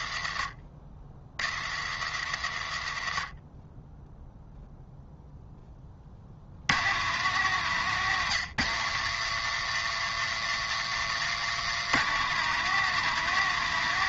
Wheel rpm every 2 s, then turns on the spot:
40, 40, 0, 130, 120, 130, 160.
10-12